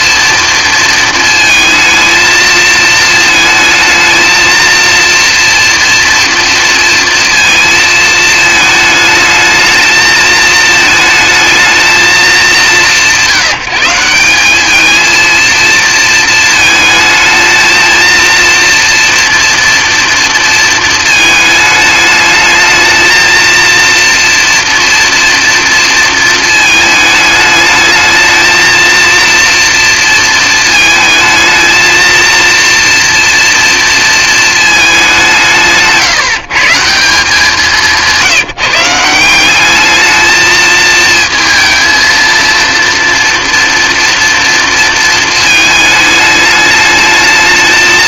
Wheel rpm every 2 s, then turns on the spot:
230, 220, 230, 230, 220, 220, 190, 220, 220, 230, 230, 220, 240, 220, 230, 220, 230, 210, 160, 170, 220, 230, 230, 220.
none